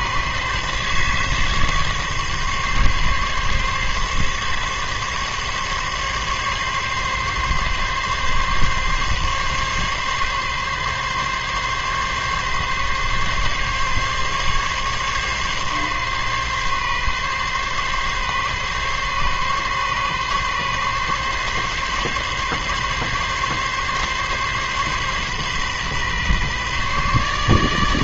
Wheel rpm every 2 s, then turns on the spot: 140, 140, 140, 140, 140, 140, 140, 140, 140, 140, 140, 140, 140, 140.
none